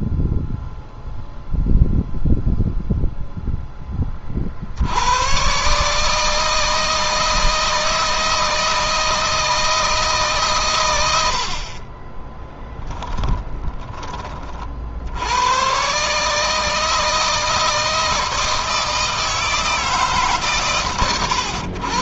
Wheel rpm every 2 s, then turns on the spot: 0, 0, 80, 160, 160, 110, 10, 60, 160, 160, 130.
12-14